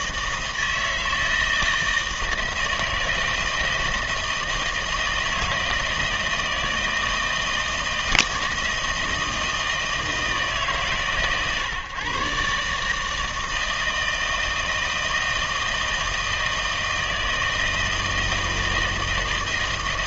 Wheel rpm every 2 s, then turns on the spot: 160, 160, 160, 160, 160, 150, 150, 160, 160, 160.
none